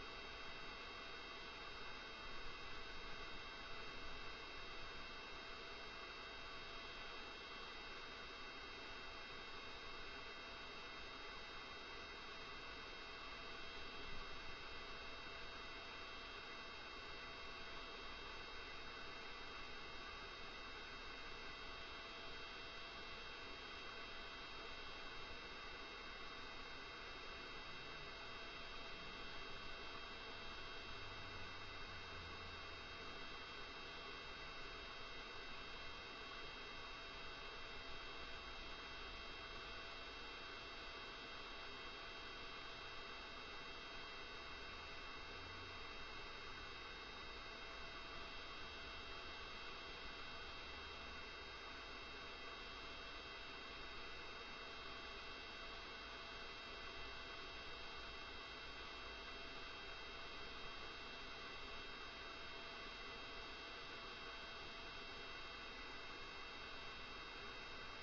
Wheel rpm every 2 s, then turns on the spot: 0, 0, 0, 0, 0, 0, 0, 0, 0, 0, 0, 0, 0, 0, 0, 0, 0, 0, 0, 0, 0, 0, 0, 0, 0, 0, 0, 0, 0, 0, 0, 0, 0, 0.
none